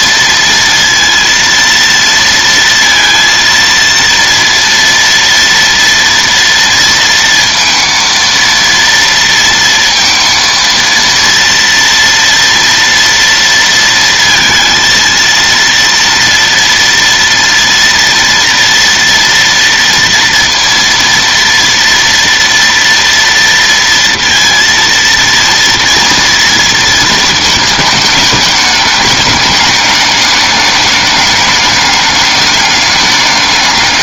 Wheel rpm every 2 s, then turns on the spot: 230, 230, 230, 230, 230, 230, 230, 230, 230, 230, 230, 230, 230, 230, 210, 210, 200.
none